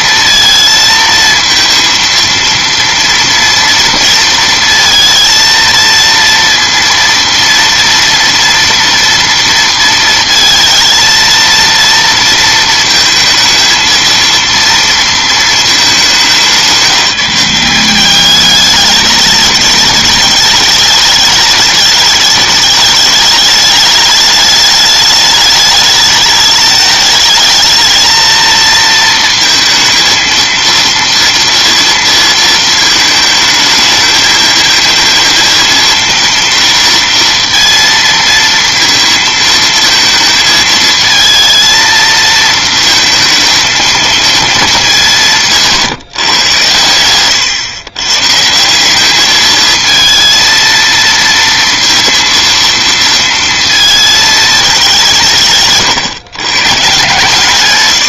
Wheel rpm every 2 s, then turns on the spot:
230, 230, 230, 230, 230, 230, 220, 230, 190, 210, 210, 210, 210, 210, 230, 230, 220, 220, 230, 230, 220, 230, 210, 120, 170, 230, 230, 200, 130.
none